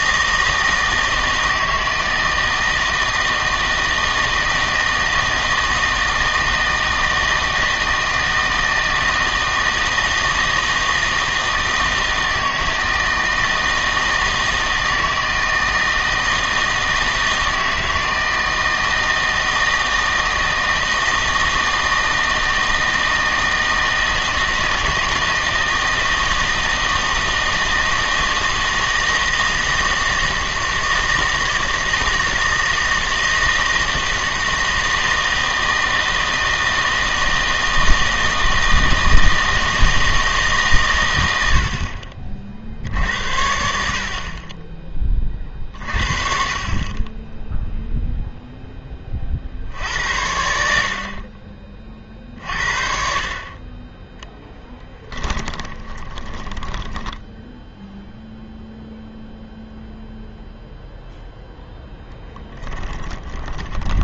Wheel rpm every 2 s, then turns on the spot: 160, 160, 160, 160, 160, 160, 160, 160, 160, 160, 160, 160, 160, 160, 160, 160, 160, 160, 160, 160, 130, 60, 30, 30, 20, 60, 50, 10, 10, 0, 0, 10.
54-58 62-64